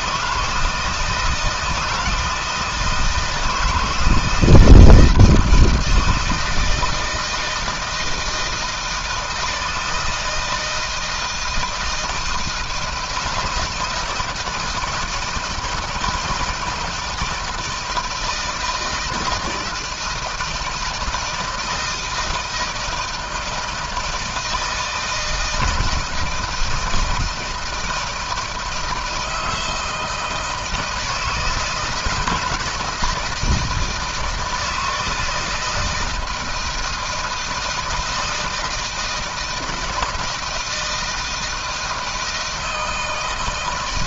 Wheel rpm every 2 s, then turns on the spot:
160, 160, 160, 160, 160, 170, 160, 160, 170, 160, 160, 160, 160, 160, 160, 160, 160, 160, 160, 160, 160, 160.
none